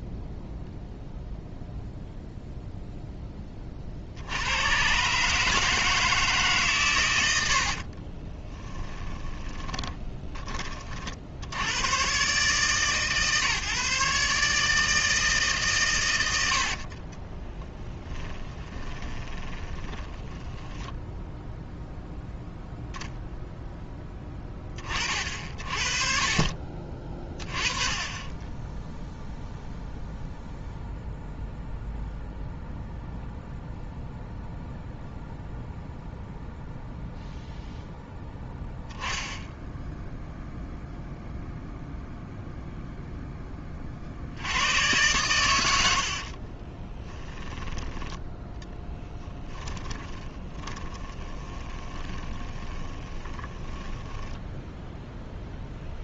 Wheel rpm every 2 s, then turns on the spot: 0, 0, 120, 130, 20, 40, 140, 150, 50, 20, 10, 0, 30, 30, 0, 0, 0, 0, 0, 0, 0, 0, 100, 20, 10, 20, 20, 0.
8-10 18-22 46-54